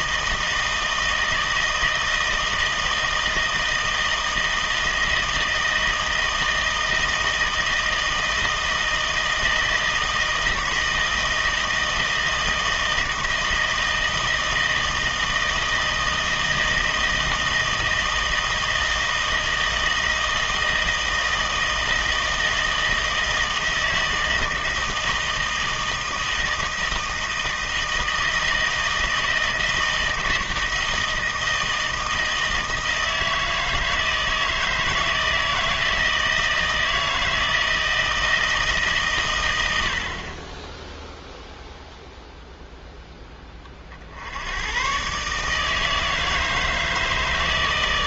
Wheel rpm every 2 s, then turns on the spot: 160, 160, 160, 160, 160, 160, 160, 160, 160, 160, 160, 160, 160, 160, 160, 160, 160, 160, 160, 150, 20, 0, 100, 160.
none